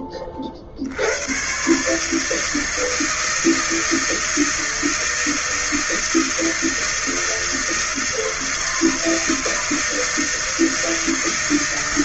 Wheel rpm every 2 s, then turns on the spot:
40, 160, 160, 160, 160, 160.
none